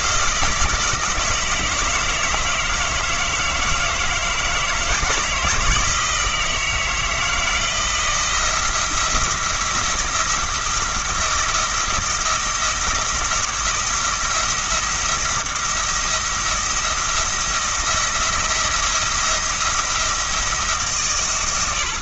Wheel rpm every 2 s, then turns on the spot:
160, 160, 160, 160, 170, 170, 170, 170, 170, 170, 160.
none